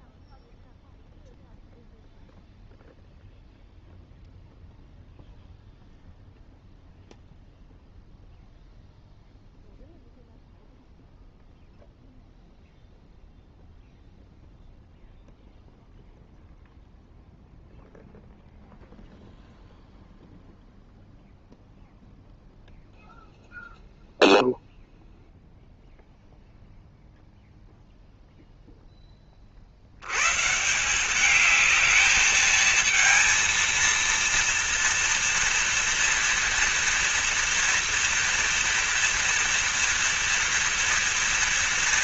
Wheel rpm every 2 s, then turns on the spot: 0, 0, 0, 0, 0, 0, 0, 0, 0, 0, 0, 0, 0, 0, 0, 150, 220, 230, 230, 230, 230.
none